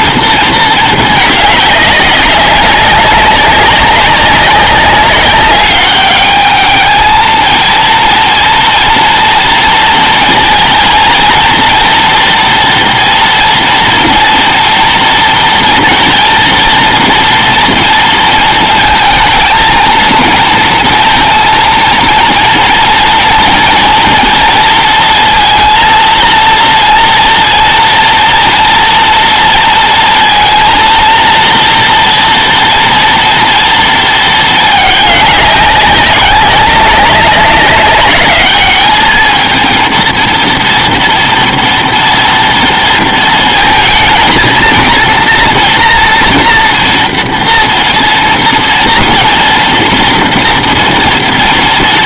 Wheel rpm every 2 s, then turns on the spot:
230, 190, 200, 210, 230, 230, 230, 230, 230, 230, 230, 230, 230, 230, 230, 230, 230, 220, 190, 200, 230, 230, 230, 230, 230, 230.
none